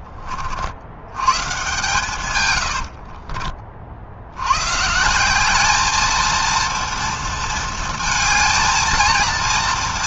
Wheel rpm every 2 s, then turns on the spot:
40, 110, 110, 230, 220.
none